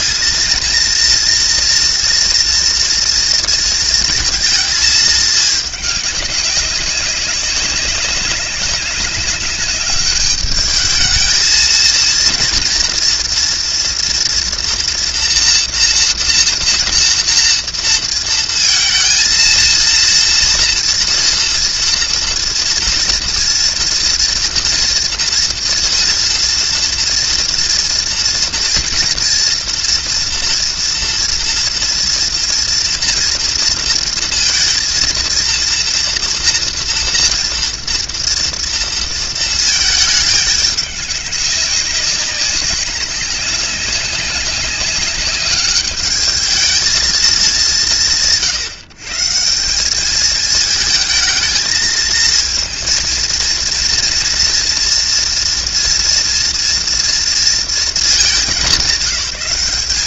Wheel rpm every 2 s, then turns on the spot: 230, 240, 220, 200, 200, 210, 230, 230, 230, 220, 230, 230, 230, 230, 230, 240, 230, 230, 240, 230, 200, 190, 190, 220, 130, 220, 230, 230, 230, 190.
none